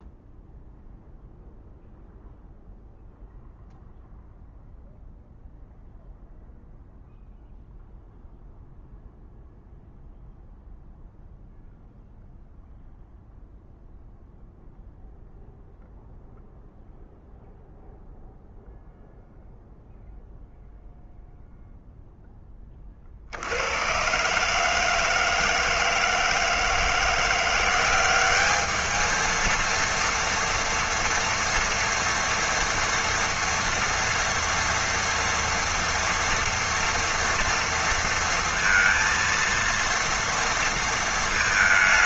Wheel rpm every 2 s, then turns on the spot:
0, 0, 0, 0, 0, 0, 0, 0, 0, 0, 0, 40, 160, 170, 220, 240, 230, 230, 230, 230, 220.
none